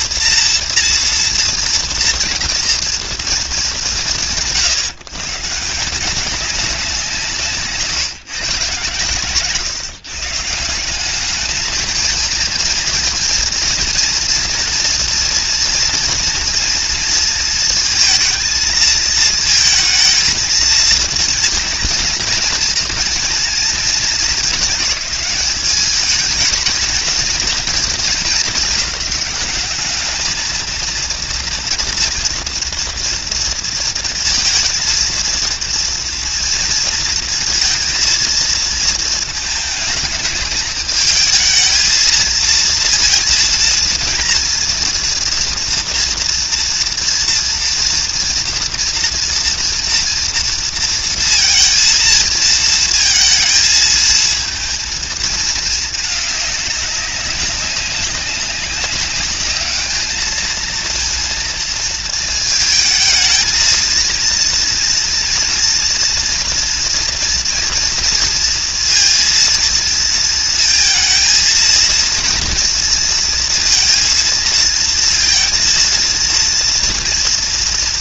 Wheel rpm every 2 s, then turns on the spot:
230, 230, 140, 190, 140, 170, 230, 230, 230, 220, 230, 230, 210, 220, 220, 220, 230, 230, 230, 220, 210, 220, 230, 230, 230, 230, 230, 230, 200, 190, 220, 220, 230, 230, 230, 230, 230, 230, 240.
none